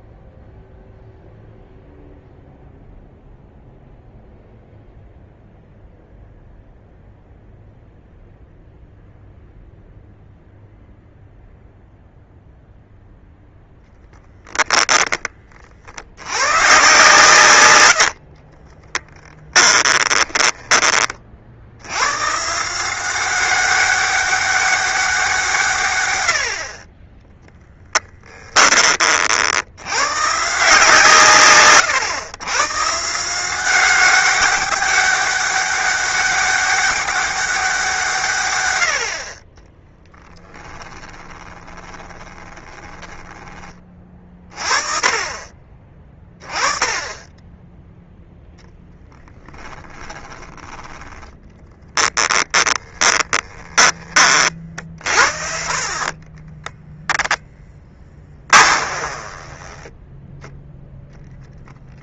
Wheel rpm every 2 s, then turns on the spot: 0, 0, 0, 0, 0, 0, 0, 20, 130, 20, 30, 170, 190, 40, 30, 140, 140, 200, 200, 70, 20, 10, 30, 10, 10, 10, 10, 50, 0, 20, 0.
18-20 40-44 48-50 52-54 58-60